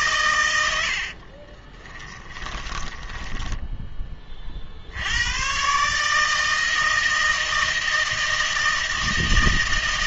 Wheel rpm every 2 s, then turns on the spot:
80, 20, 60, 160, 160.
2-4